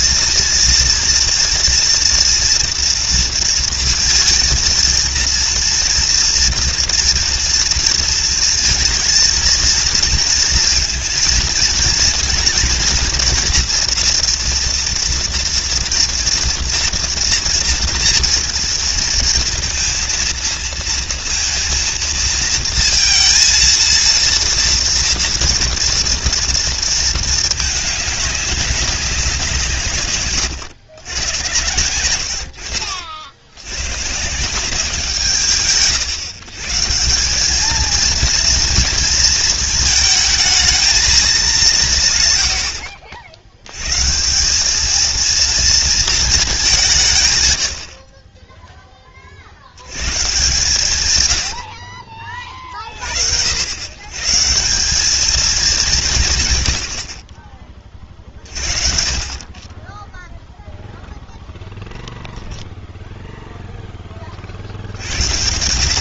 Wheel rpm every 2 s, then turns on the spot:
230, 230, 230, 230, 230, 230, 230, 230, 230, 230, 230, 230, 230, 230, 200, 110, 60, 170, 140, 230, 220, 80, 210, 170, 10, 140, 40, 180, 90, 50, 0, 0, 70.
none